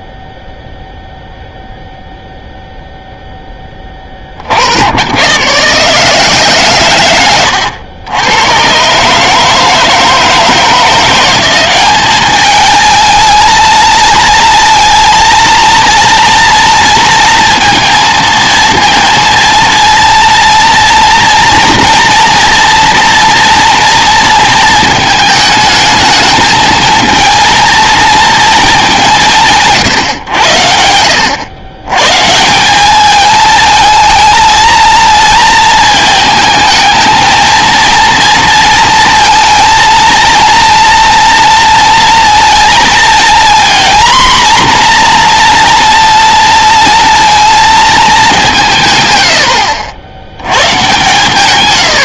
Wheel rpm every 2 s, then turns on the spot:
0, 0, 100, 120, 150, 180, 220, 230, 230, 230, 240, 230, 220, 230, 190, 80, 200, 230, 220, 230, 230, 230, 240, 230, 160, 120.
none